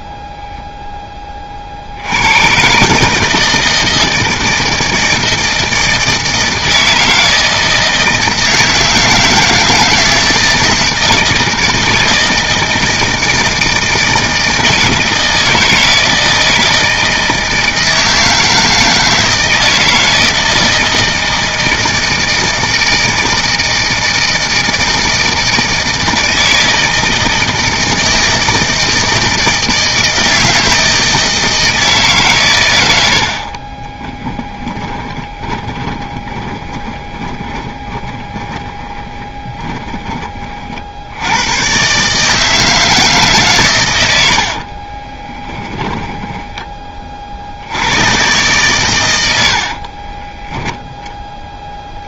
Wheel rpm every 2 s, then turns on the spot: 0, 130, 160, 160, 160, 160, 160, 160, 160, 160, 160, 160, 160, 160, 160, 160, 120, 10, 20, 30, 50, 160, 30, 20, 120, 0.
34-40 44-46